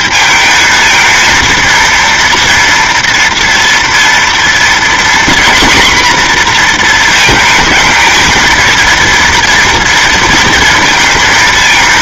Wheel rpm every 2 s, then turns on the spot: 220, 230, 240, 230, 230, 230.
none